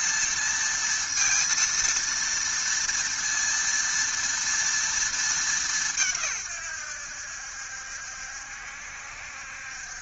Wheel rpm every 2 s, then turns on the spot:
230, 230, 230, 120, 70.
none